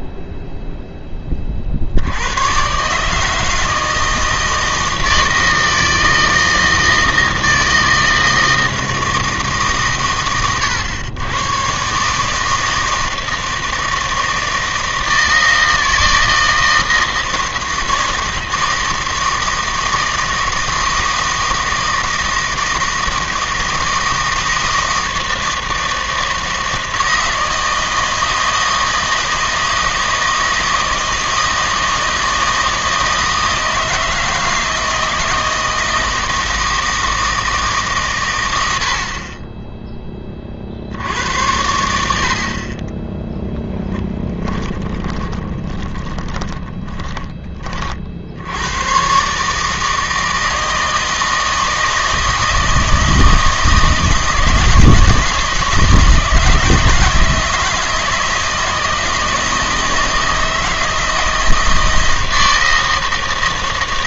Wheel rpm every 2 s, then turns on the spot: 0, 110, 160, 160, 160, 110, 160, 160, 160, 160, 160, 160, 160, 160, 160, 160, 160, 160, 160, 90, 50, 30, 10, 20, 90, 160, 160, 160, 160, 160, 160, 160.
44-48